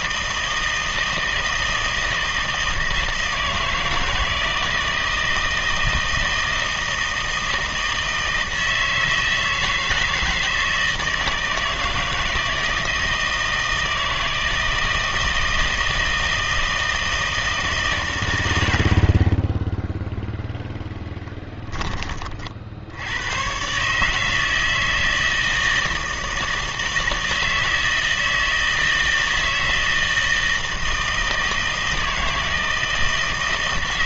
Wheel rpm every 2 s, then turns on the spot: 160, 160, 160, 160, 160, 160, 160, 160, 160, 70, 0, 60, 160, 160, 160, 160, 160.
none